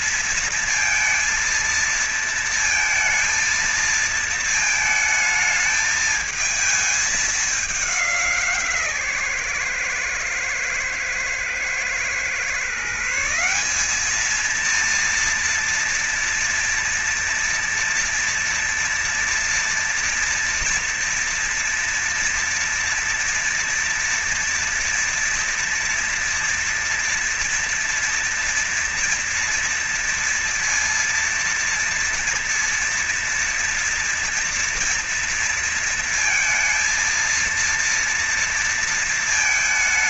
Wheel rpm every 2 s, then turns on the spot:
230, 230, 220, 220, 170, 120, 130, 210, 230, 230, 230, 230, 230, 230, 230, 240, 230, 230, 230, 230.
none